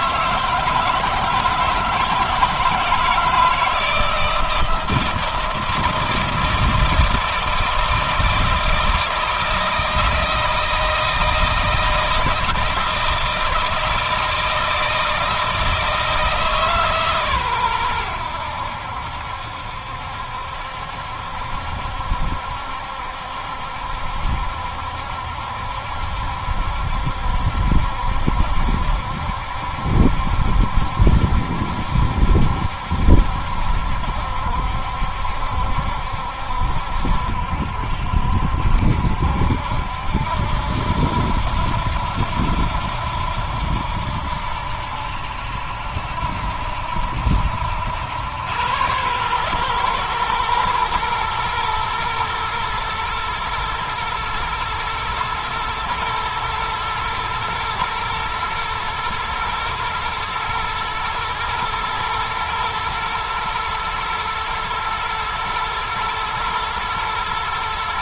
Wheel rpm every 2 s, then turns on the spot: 170, 160, 160, 160, 160, 170, 160, 160, 140, 80, 70, 70, 70, 70, 70, 70, 70, 70, 70, 70, 80, 80, 80, 80, 110, 120, 110, 120, 110, 110, 120, 120, 110, 110.
none